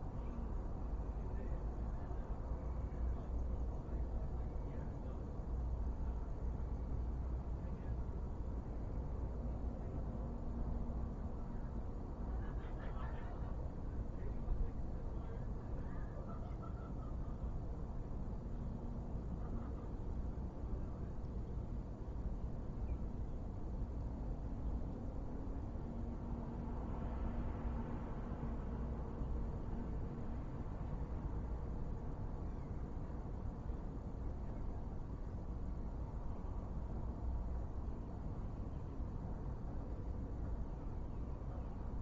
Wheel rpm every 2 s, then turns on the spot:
0, 0, 0, 0, 0, 0, 0, 0, 0, 0, 0, 0, 0, 0, 0, 0, 0, 0, 0, 0, 0.
none